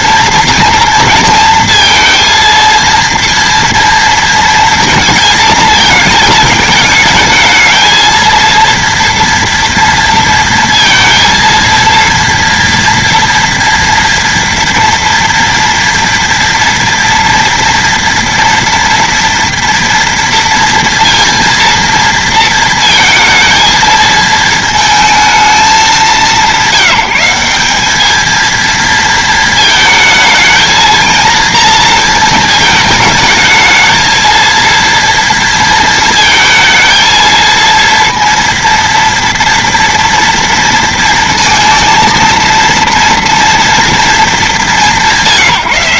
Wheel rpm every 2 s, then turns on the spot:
230, 230, 230, 220, 230, 230, 230, 230, 230, 230, 230, 230, 220, 170, 230, 230, 220, 230, 230, 230, 230, 230, 190.
none